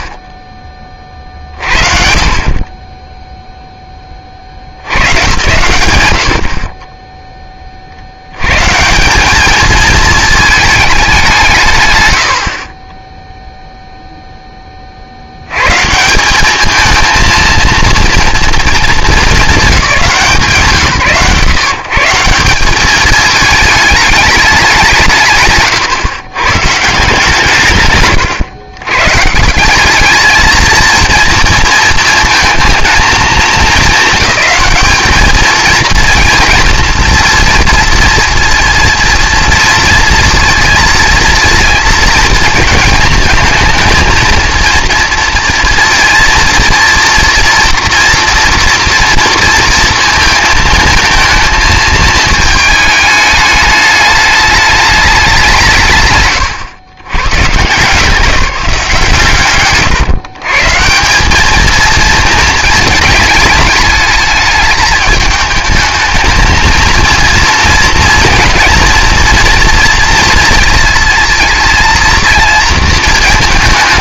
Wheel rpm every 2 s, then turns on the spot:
30, 10, 90, 40, 160, 210, 30, 20, 220, 230, 150, 190, 200, 130, 120, 220, 220, 210, 230, 230, 230, 220, 230, 230, 230, 230, 220, 210, 100, 150, 150, 220, 210, 220, 230, 220, 220.
none